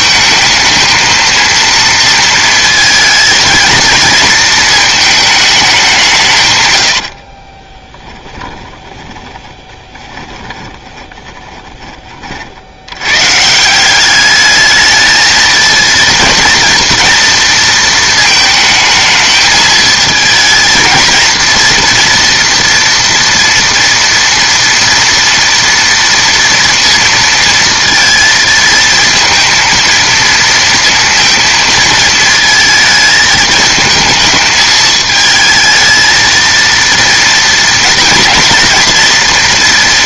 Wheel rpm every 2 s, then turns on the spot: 220, 220, 220, 80, 20, 20, 90, 210, 230, 220, 220, 230, 230, 230, 230, 230, 220, 220, 230, 240.
8-12